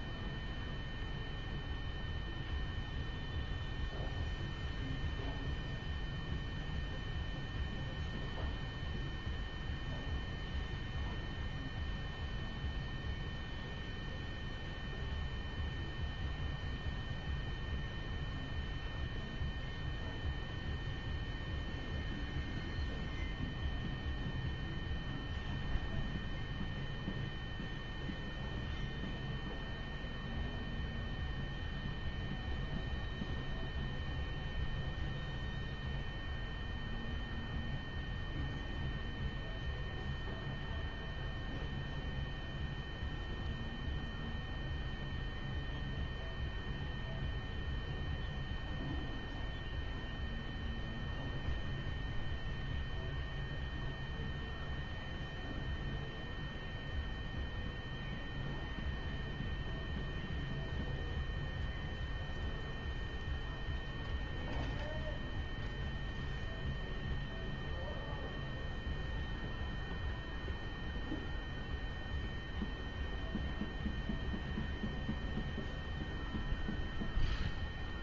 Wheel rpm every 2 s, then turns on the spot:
0, 0, 0, 0, 0, 0, 0, 0, 0, 0, 0, 0, 0, 0, 0, 0, 0, 0, 0, 0, 0, 0, 0, 0, 0, 0, 0, 0, 0, 0, 0, 0, 0, 0, 0, 0, 0, 0, 0.
none